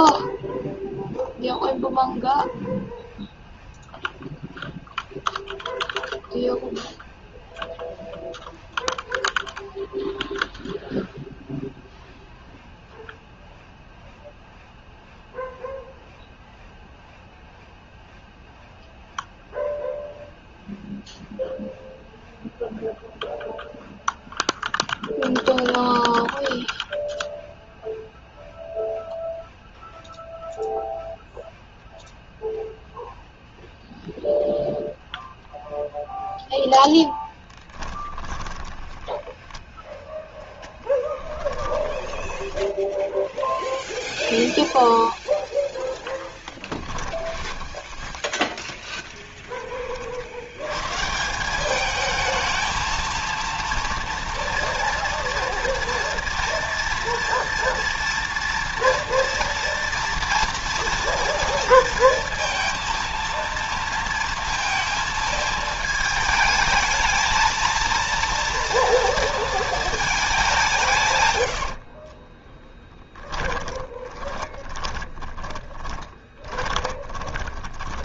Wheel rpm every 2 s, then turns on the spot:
0, 0, 0, 0, 0, 0, 0, 0, 0, 0, 0, 0, 0, 0, 0, 0, 0, 0, 0, 20, 10, 10, 0, 10, 10, 110, 220, 230, 230, 230, 240, 230, 230, 220, 230, 170, 10, 20, 20.
38-40 42-44 46-50 72-78